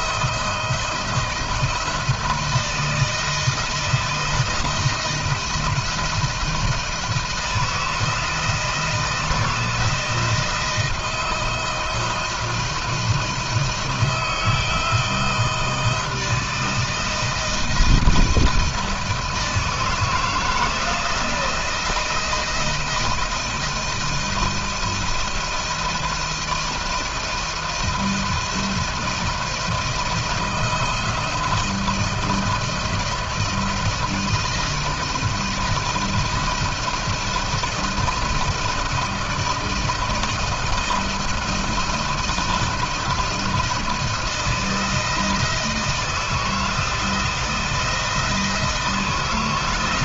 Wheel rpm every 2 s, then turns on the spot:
170, 160, 170, 160, 160, 160, 160, 160, 160, 160, 160, 160, 170, 170, 170, 160, 170, 160, 170, 170, 170, 170, 170, 160, 160.
none